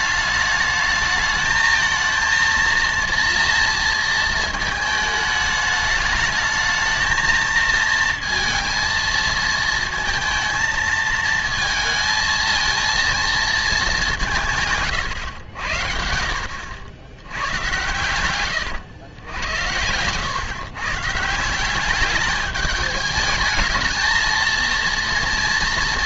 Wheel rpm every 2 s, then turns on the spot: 210, 230, 220, 220, 230, 230, 230, 140, 80, 110, 130, 210, 230.
none